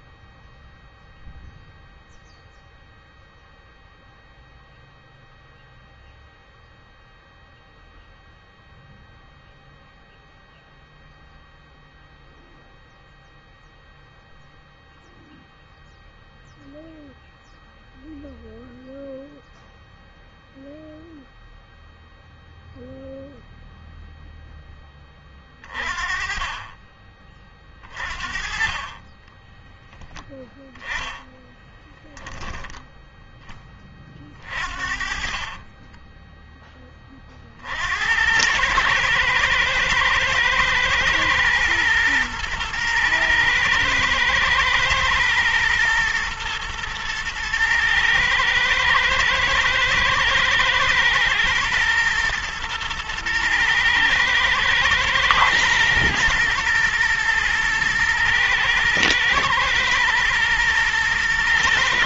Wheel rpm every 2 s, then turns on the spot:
0, 0, 0, 0, 0, 0, 0, 0, 0, 0, 0, 0, 20, 30, 30, 10, 10, 50, 20, 110, 110, 120, 120, 110, 110, 110, 110, 110, 120, 110, 120.
28-30 34-36